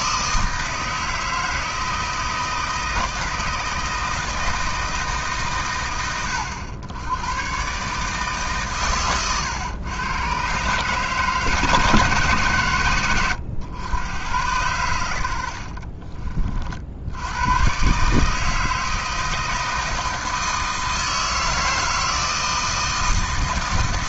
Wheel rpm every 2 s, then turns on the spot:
160, 160, 160, 90, 130, 130, 120, 100, 50, 160, 160, 160.
none